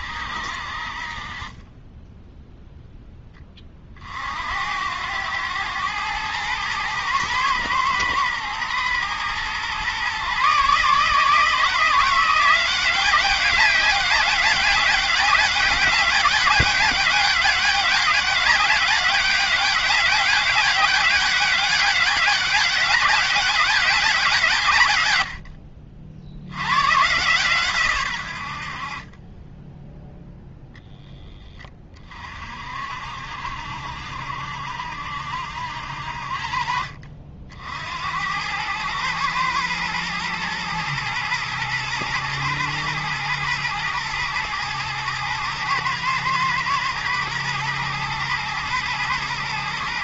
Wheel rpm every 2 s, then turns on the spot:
50, 0, 90, 110, 110, 150, 190, 200, 200, 200, 200, 200, 130, 110, 50, 10, 60, 70, 50, 110, 110, 110, 110, 110, 120.
none